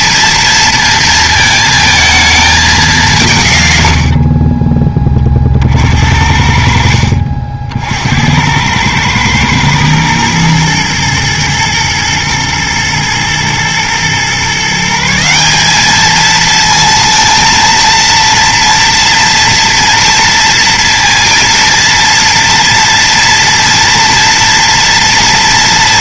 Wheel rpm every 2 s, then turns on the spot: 230, 200, 20, 70, 100, 110, 110, 150, 230, 230, 230, 230, 230.
none